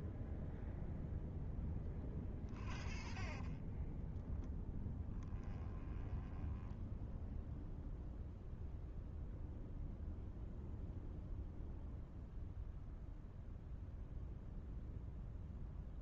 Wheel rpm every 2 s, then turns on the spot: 0, 40, 10, 10, 0, 0, 0, 0.
2-8